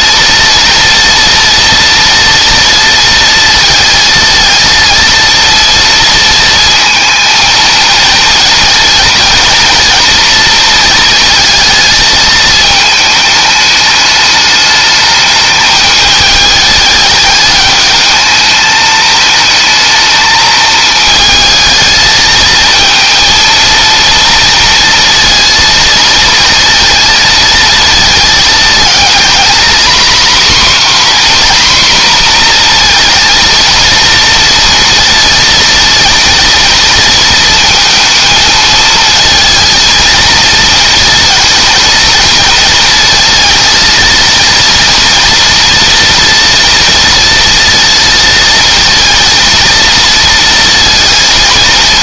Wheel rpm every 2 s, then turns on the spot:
230, 230, 230, 230, 230, 230, 220, 210, 210, 220, 220, 220, 230, 230, 230, 270, 230, 230, 230, 220, 230, 230, 230, 230, 230, 230.
none